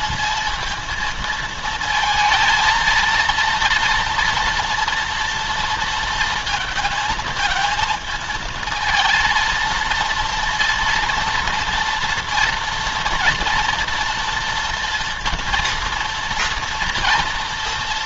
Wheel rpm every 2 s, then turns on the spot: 220, 220, 230, 230, 230, 230, 230, 230, 230.
none